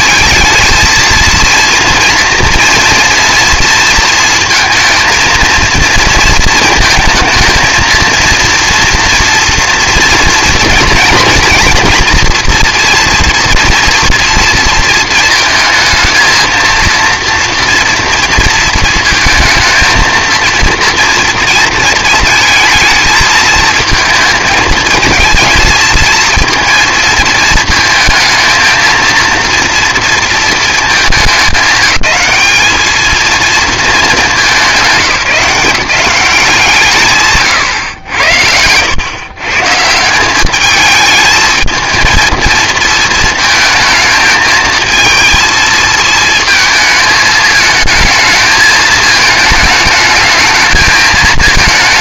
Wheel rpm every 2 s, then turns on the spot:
230, 240, 220, 230, 240, 230, 240, 220, 230, 230, 230, 220, 220, 220, 230, 200, 220, 170, 140, 120, 210, 220, 230, 220, 220, 220.
none